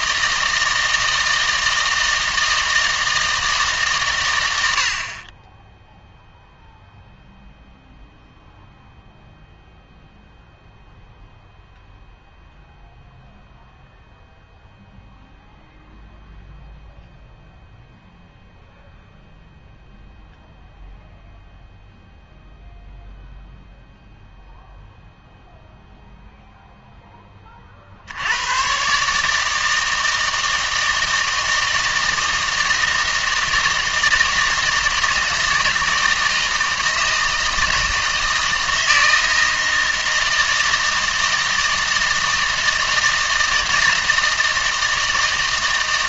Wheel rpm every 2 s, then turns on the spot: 160, 160, 80, 0, 0, 0, 0, 0, 0, 0, 0, 0, 0, 0, 130, 160, 160, 160, 160, 160, 160, 160, 160.
none